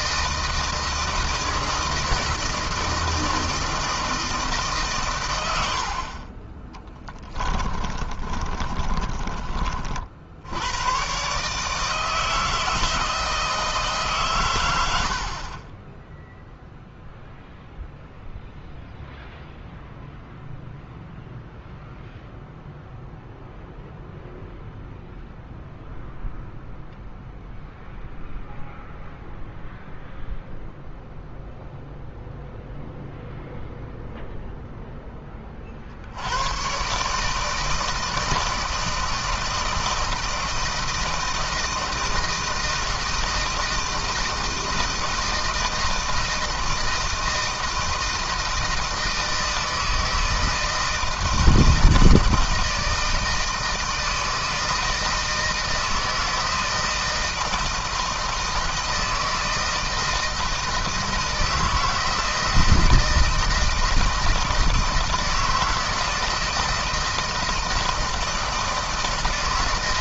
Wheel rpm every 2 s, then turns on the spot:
160, 160, 140, 20, 30, 120, 160, 80, 0, 0, 0, 0, 0, 0, 0, 0, 0, 10, 120, 160, 160, 160, 160, 160, 160, 160, 160, 160, 160, 160, 160, 160, 160, 160, 160.
6-10